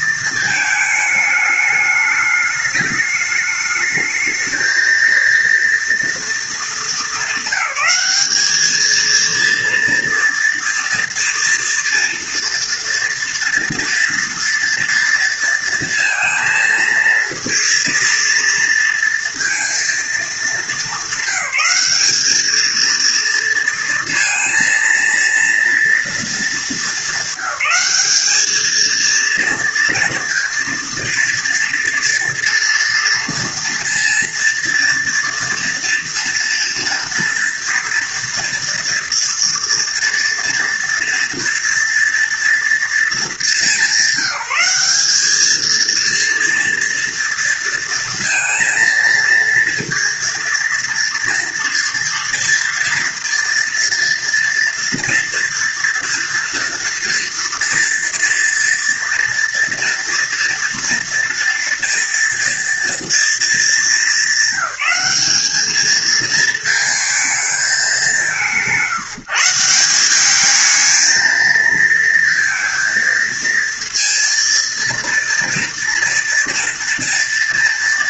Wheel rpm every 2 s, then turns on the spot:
220, 210, 220, 230, 210, 230, 230, 230, 230, 230, 220, 220, 230, 230, 220, 230, 230, 230, 240, 230, 230, 230, 200, 230, 230, 230, 230, 230, 230, 230, 240, 230, 200, 220, 180, 200, 230, 230, 230.
none